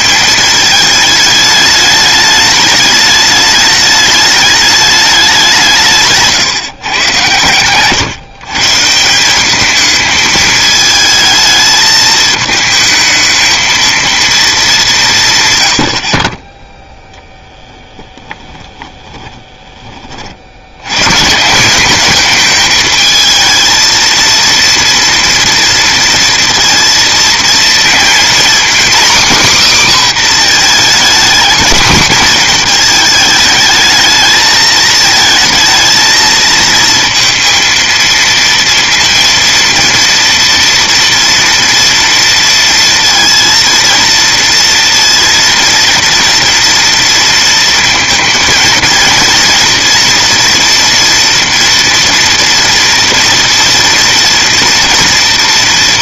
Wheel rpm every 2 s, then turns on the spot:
220, 210, 210, 140, 150, 220, 220, 200, 10, 10, 80, 230, 230, 230, 250, 240, 230, 220, 230, 230, 240, 230, 230, 230, 230, 230, 230, 230.
18-20